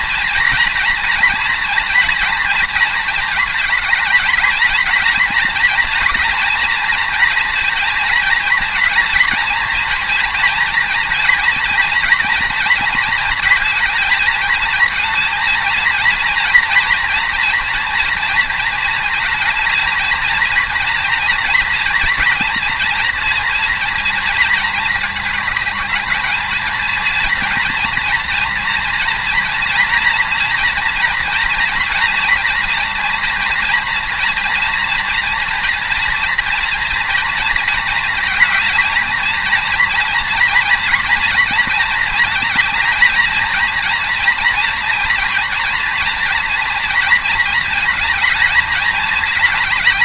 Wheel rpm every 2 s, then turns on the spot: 230, 230, 220, 240, 230, 230, 230, 220, 230, 230, 230, 240, 220, 230, 230, 230, 230, 230, 240, 230, 230, 220, 230, 230, 220.
none